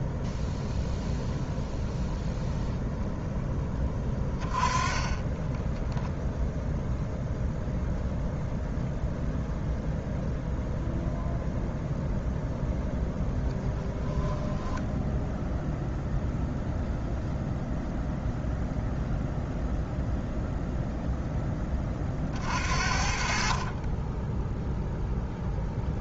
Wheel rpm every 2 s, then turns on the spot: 0, 0, 20, 0, 0, 0, 0, 0, 0, 0, 0, 50, 0.
4-6